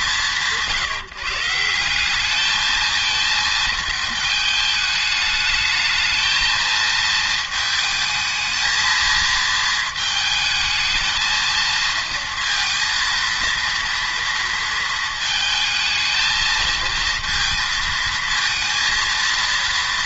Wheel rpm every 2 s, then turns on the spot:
160, 220, 220, 220, 220, 220, 230, 230, 220, 230.
none